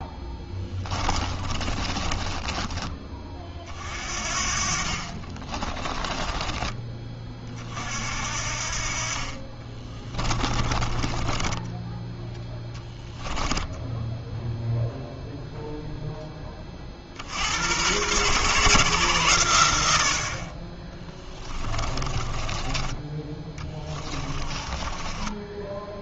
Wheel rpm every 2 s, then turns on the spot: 20, 20, 50, 20, 50, 20, 10, 0, 30, 140, 30, 20, 20.
0-2 10-14 22-26